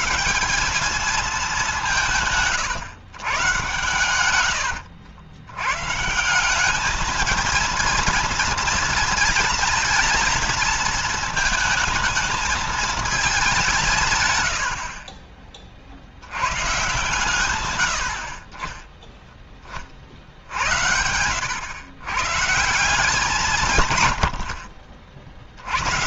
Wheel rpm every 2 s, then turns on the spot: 200, 130, 80, 190, 230, 230, 220, 70, 120, 40, 60, 160, 80.
4-6